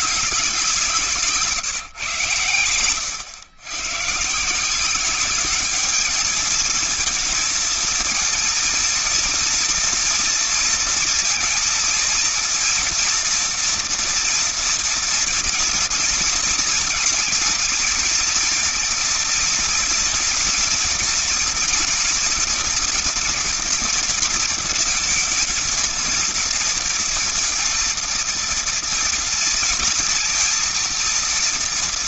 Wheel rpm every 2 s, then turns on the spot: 190, 110, 160, 220, 230, 230, 230, 230, 230, 230, 230, 230, 230, 230, 230, 230.
none